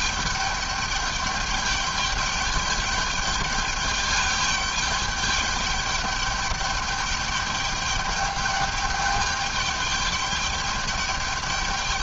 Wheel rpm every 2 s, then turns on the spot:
210, 210, 210, 210, 210, 210.
none